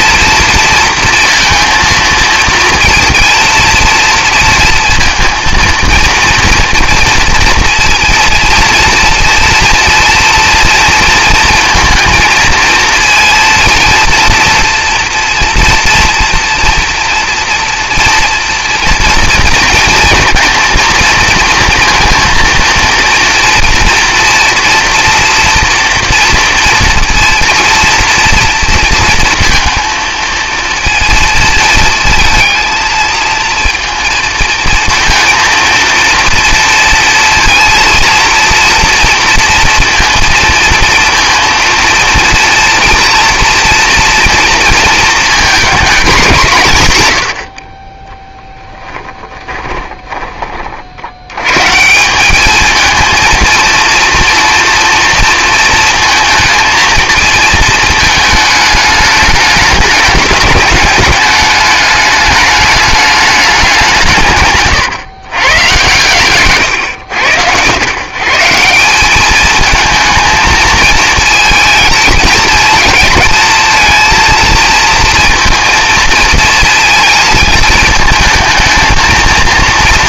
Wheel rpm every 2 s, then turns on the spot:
230, 230, 230, 230, 230, 240, 230, 230, 230, 230, 230, 230, 230, 230, 230, 230, 230, 230, 230, 230, 230, 240, 230, 160, 10, 40, 220, 230, 230, 210, 210, 210, 130, 120, 170, 220, 220, 230, 230, 220.
48-50